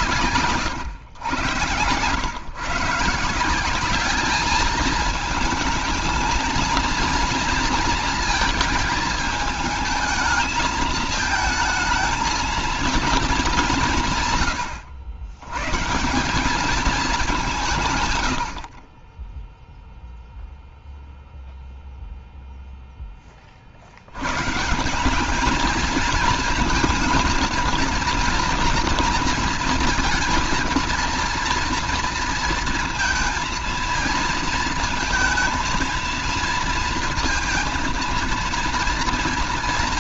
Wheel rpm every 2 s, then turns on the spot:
140, 120, 210, 230, 230, 220, 230, 120, 190, 80, 0, 0, 120, 230, 240, 230, 230, 220, 230, 230.
0-2